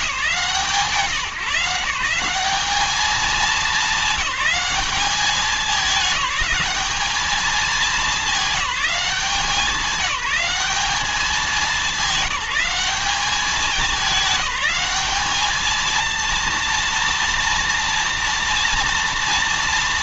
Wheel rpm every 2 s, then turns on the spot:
160, 210, 210, 210, 190, 190, 190, 210, 230, 230.
none